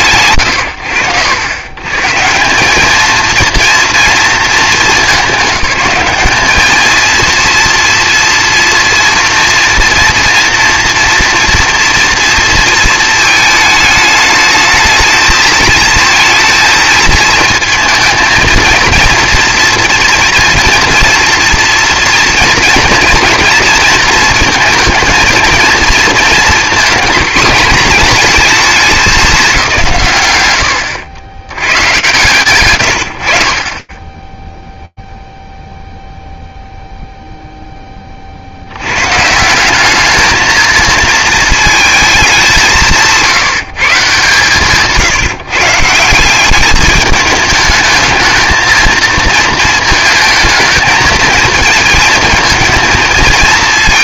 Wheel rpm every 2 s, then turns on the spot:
100, 210, 210, 200, 230, 230, 230, 220, 220, 230, 230, 240, 230, 220, 220, 100, 100, 0, 0, 140, 230, 170, 150, 210, 220, 230, 230.
none